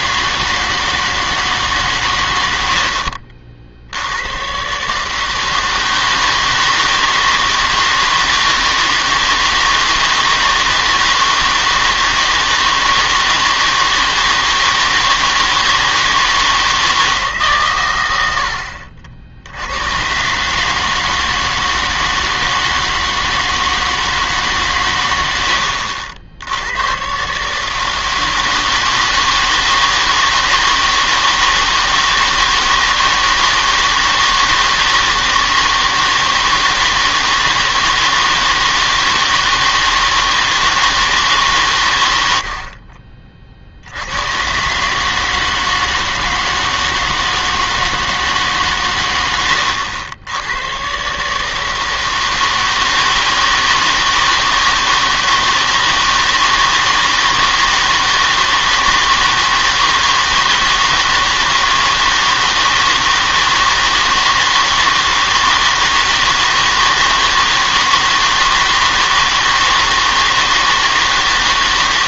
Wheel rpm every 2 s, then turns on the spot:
160, 70, 130, 160, 160, 160, 160, 160, 160, 60, 150, 160, 130, 90, 160, 160, 160, 160, 160, 160, 160, 60, 130, 160, 130, 110, 160, 160, 160, 160, 160, 160, 160, 160, 160, 160.
2-4